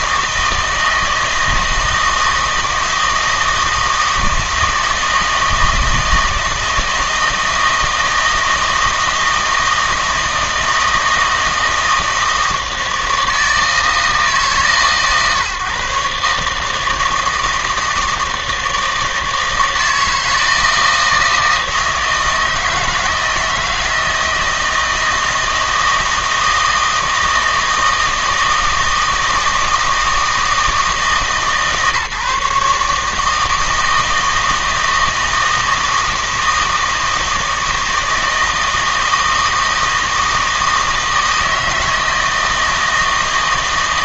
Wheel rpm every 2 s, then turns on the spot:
160, 160, 160, 160, 160, 160, 160, 140, 160, 160, 160, 160, 160, 160, 160, 160, 150, 160, 160, 160, 160, 160.
none